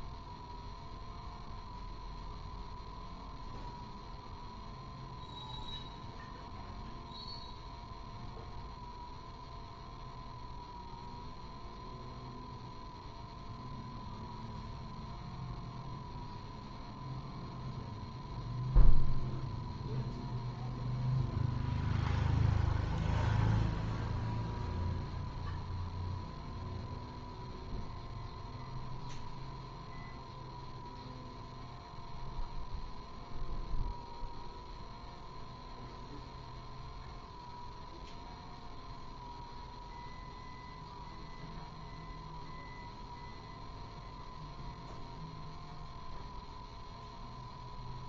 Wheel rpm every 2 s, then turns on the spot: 0, 0, 0, 0, 0, 0, 0, 0, 0, 0, 0, 0, 0, 0, 0, 0, 0, 0, 0, 0, 0, 0, 0, 0.
none